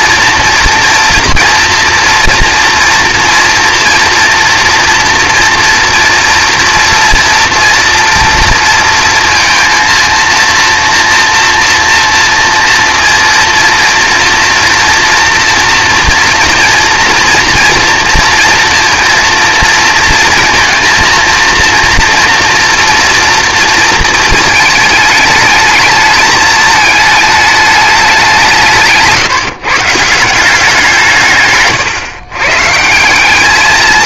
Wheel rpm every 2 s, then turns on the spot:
240, 230, 230, 240, 230, 230, 230, 230, 230, 230, 230, 230, 220, 220, 170, 180, 150.
none